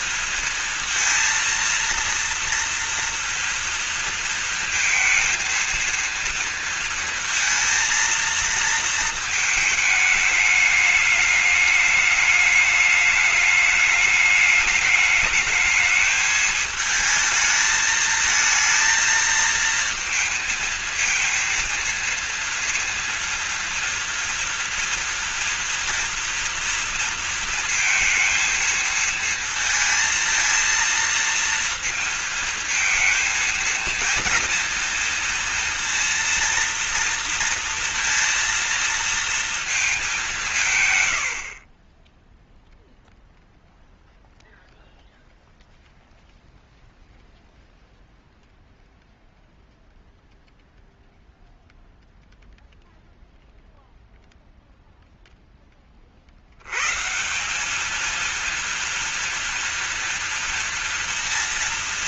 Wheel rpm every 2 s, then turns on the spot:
230, 230, 230, 230, 220, 210, 210, 210, 220, 220, 230, 230, 230, 230, 230, 230, 220, 230, 230, 230, 140, 0, 0, 0, 0, 0, 0, 0, 110, 230, 230.
none